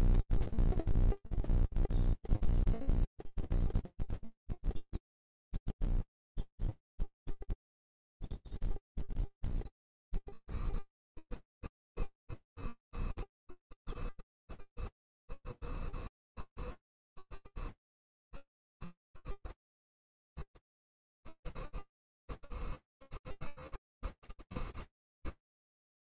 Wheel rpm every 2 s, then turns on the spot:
0, 0, 0, 0, 0, 0, 0, 0, 0, 0, 0, 0, 0.
none